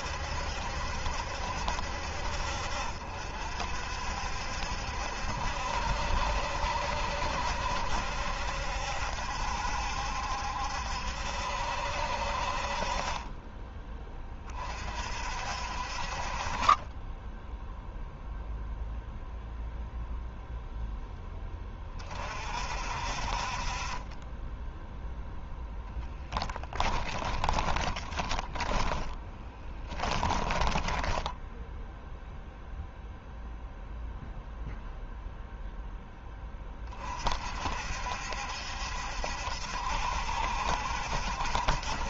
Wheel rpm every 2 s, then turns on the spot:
70, 60, 70, 60, 70, 70, 40, 40, 20, 0, 0, 50, 10, 10, 10, 10, 0, 0, 20, 70, 70.
26-32